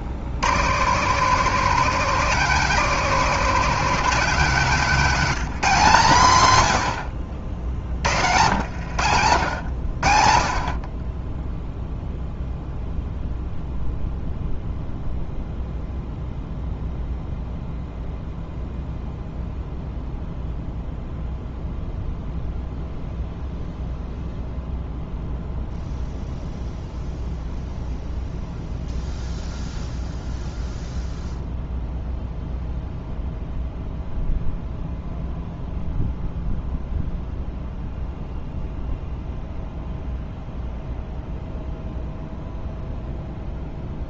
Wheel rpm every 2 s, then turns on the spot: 150, 210, 180, 90, 100, 30, 0, 0, 0, 0, 0, 0, 0, 0, 0, 0, 0, 0, 0, 0, 0, 0.
8-10